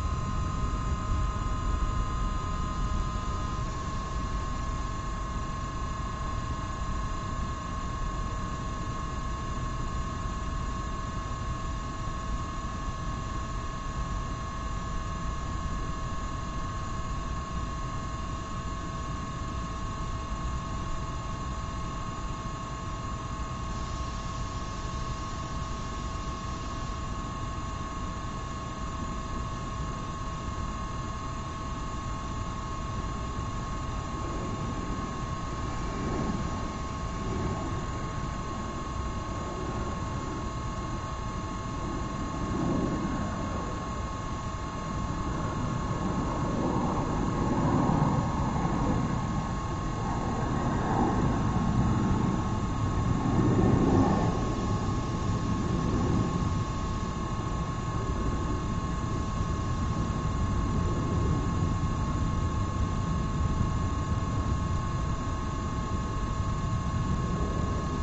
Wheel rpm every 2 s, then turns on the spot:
0, 0, 0, 0, 0, 0, 0, 0, 0, 0, 0, 0, 0, 0, 0, 0, 0, 0, 0, 0, 0, 0, 0, 0, 0, 0, 0, 0, 0, 0, 0, 0, 0, 0.
none